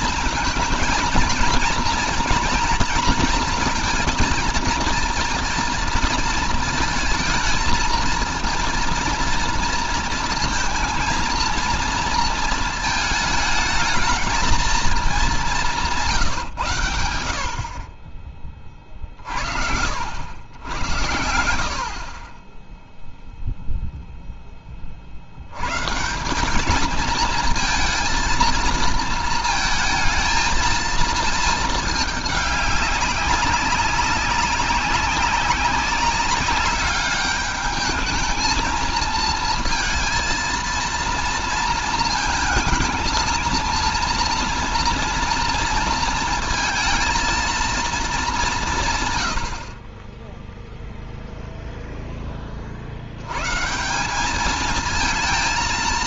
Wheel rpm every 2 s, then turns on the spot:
220, 230, 230, 220, 240, 230, 220, 200, 80, 40, 90, 0, 20, 200, 230, 220, 200, 190, 200, 220, 230, 220, 240, 230, 180, 0, 40, 210.
none